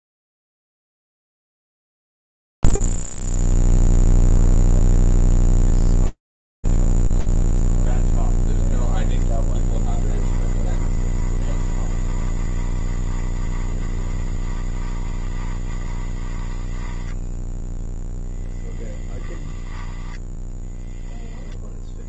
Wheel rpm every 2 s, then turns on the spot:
0, 0, 0, 0, 10, 20, 20, 20, 10, 10, 0.
10-18